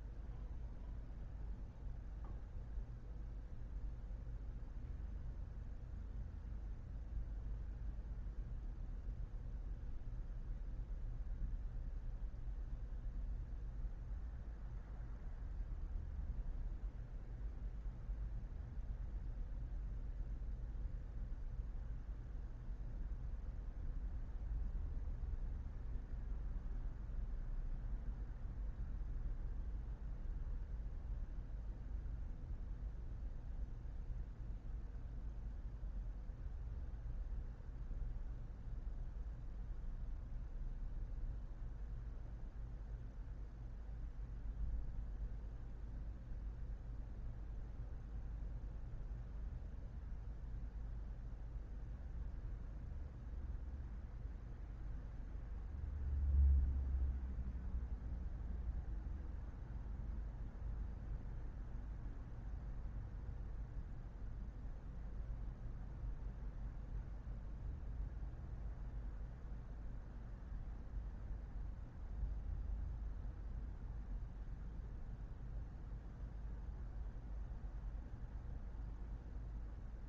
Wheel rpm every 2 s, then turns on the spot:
0, 0, 0, 0, 0, 0, 0, 0, 0, 0, 0, 0, 0, 0, 0, 0, 0, 0, 0, 0, 0, 0, 0, 0, 0, 0, 0, 0, 0, 0, 0, 0, 0, 0, 0, 0, 0, 0, 0, 0.
none